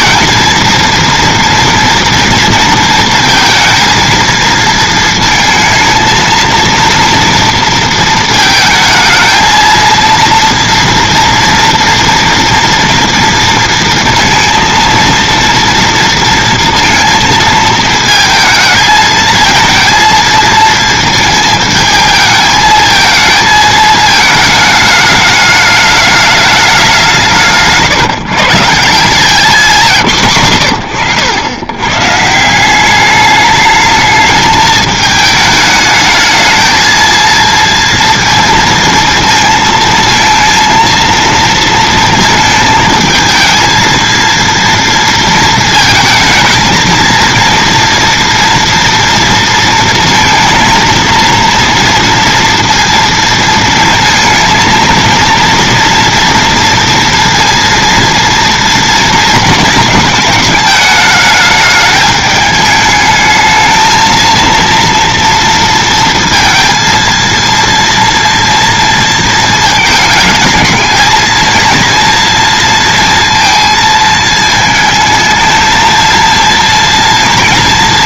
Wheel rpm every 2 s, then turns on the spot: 230, 230, 230, 230, 220, 230, 230, 230, 230, 220, 220, 220, 220, 200, 150, 90, 190, 220, 220, 230, 230, 220, 230, 230, 230, 230, 230, 230, 230, 230, 210, 210, 230, 230, 230, 220, 230, 220, 230.
none